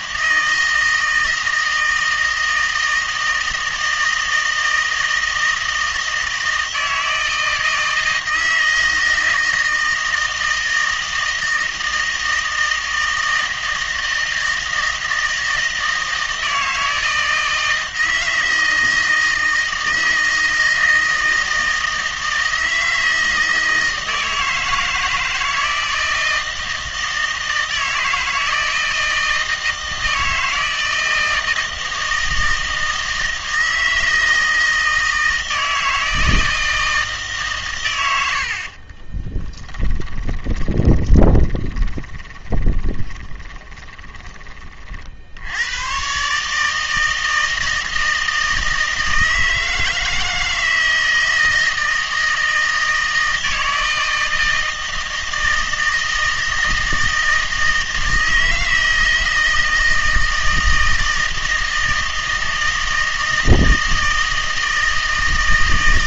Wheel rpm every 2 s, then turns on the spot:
160, 160, 160, 160, 160, 160, 160, 160, 160, 160, 160, 160, 160, 160, 160, 160, 160, 160, 160, 50, 20, 20, 30, 150, 160, 160, 160, 160, 160, 160, 160, 160, 160.
38-44